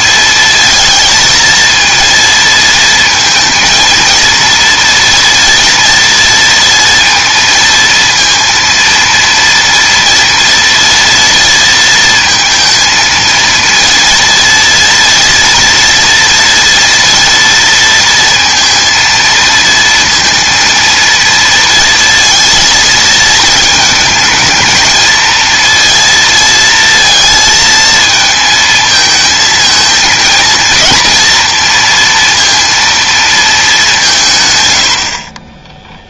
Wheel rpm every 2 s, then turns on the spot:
230, 230, 230, 230, 230, 230, 230, 230, 230, 230, 230, 230, 220, 230, 220, 230, 230, 100.
none